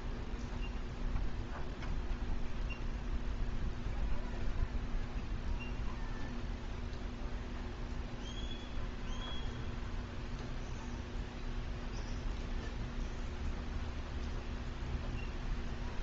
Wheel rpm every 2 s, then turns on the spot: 0, 0, 0, 0, 0, 0, 0, 0.
none